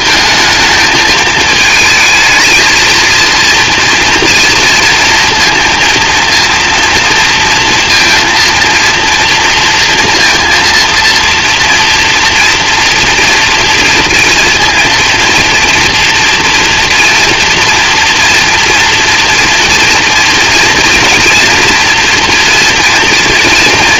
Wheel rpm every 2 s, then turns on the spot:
220, 220, 230, 230, 230, 230, 240, 230, 230, 240, 240, 230.
none